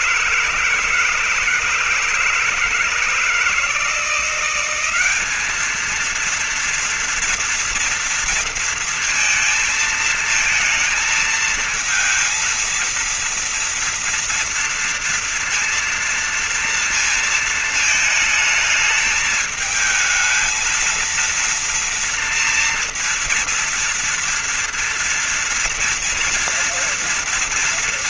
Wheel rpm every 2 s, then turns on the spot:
160, 160, 170, 220, 230, 220, 220, 230, 230, 220, 220, 230, 230, 240.
none